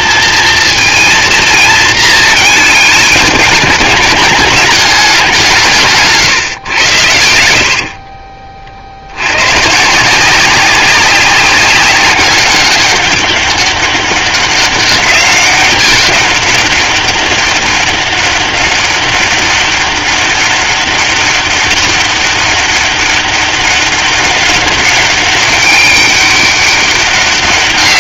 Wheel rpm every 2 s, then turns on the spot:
230, 220, 210, 120, 30, 180, 200, 200, 200, 200, 200, 200, 200, 200.
none